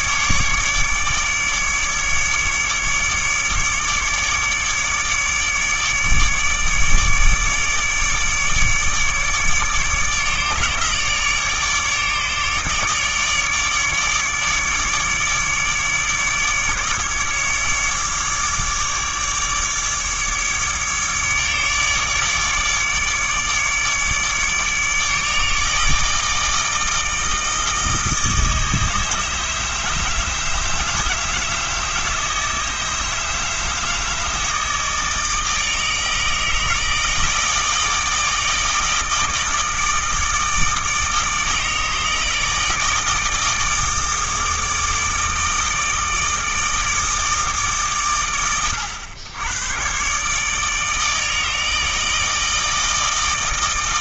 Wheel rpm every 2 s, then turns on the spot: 150, 150, 150, 150, 150, 150, 150, 150, 150, 150, 150, 150, 150, 160, 160, 160, 160, 160, 160, 160, 160, 160, 160, 160, 100, 150, 160.
none